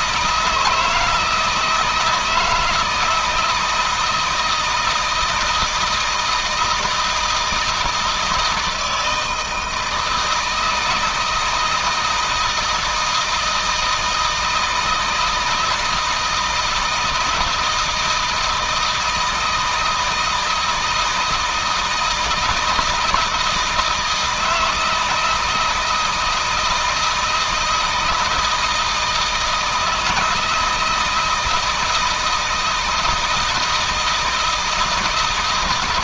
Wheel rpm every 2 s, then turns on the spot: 160, 160, 160, 170, 160, 160, 160, 160, 160, 160, 160, 160, 160, 160, 160, 160, 160, 160.
none